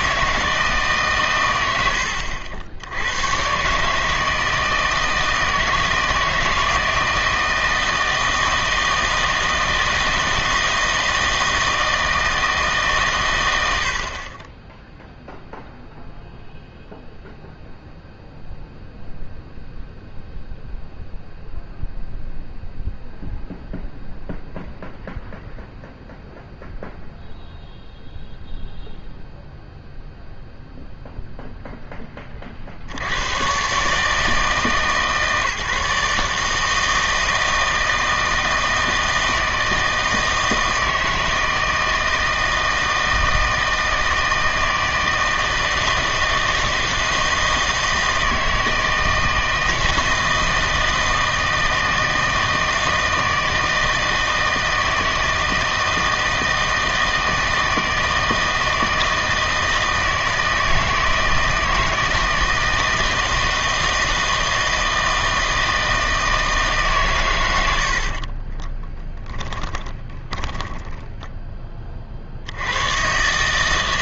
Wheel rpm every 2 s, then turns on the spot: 160, 80, 160, 160, 160, 160, 150, 10, 0, 0, 0, 0, 0, 0, 0, 0, 50, 150, 160, 160, 160, 160, 160, 160, 160, 160, 160, 160, 160, 160, 160, 160, 160, 150, 20, 10, 90.
68-72